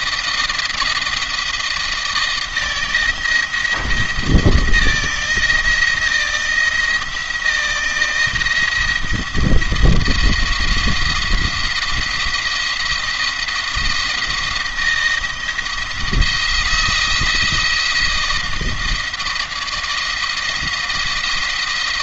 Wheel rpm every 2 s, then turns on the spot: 170, 160, 170, 160, 170, 170, 170, 170, 170, 170, 170.
none